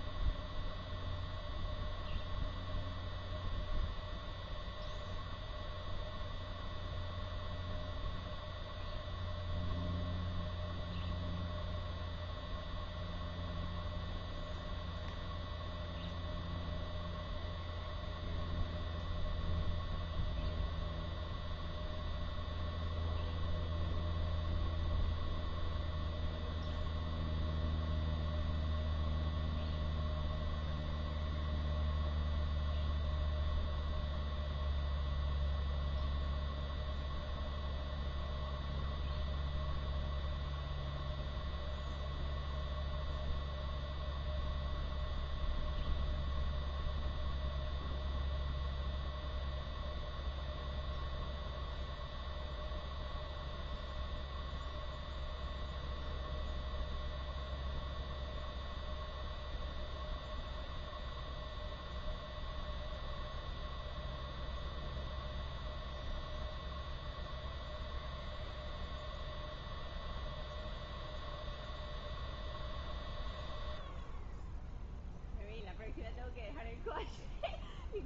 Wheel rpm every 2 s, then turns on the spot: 0, 0, 0, 0, 0, 0, 0, 0, 0, 0, 0, 0, 0, 0, 0, 0, 0, 0, 0, 0, 0, 0, 0, 0, 0, 0, 0, 0, 0, 0, 0, 0, 0, 0, 0, 0, 0, 0, 0.
none